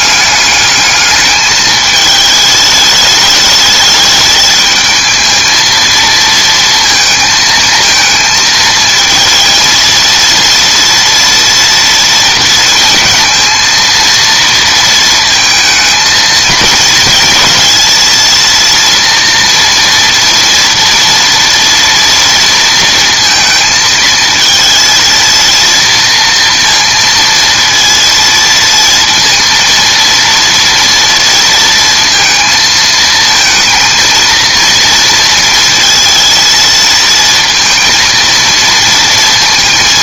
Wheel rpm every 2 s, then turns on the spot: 210, 210, 220, 230, 220, 230, 230, 230, 220, 230, 230, 230, 220, 230, 230, 230, 220, 230, 230, 230.
none